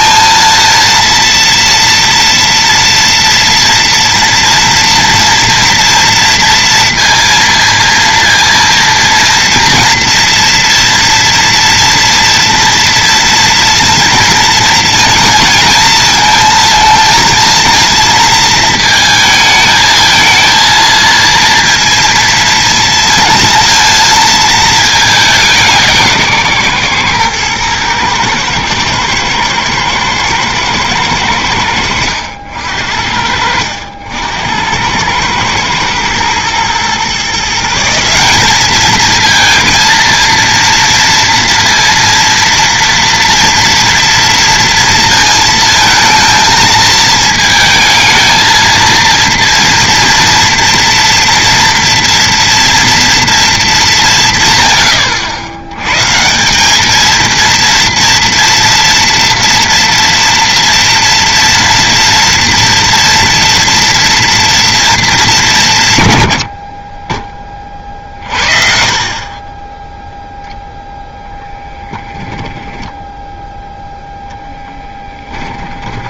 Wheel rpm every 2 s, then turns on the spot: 230, 230, 230, 230, 230, 240, 230, 230, 230, 220, 230, 230, 210, 130, 110, 110, 70, 90, 120, 210, 230, 240, 230, 220, 230, 230, 230, 150, 180, 240, 230, 230, 230, 50, 40, 0, 10, 10.
72-74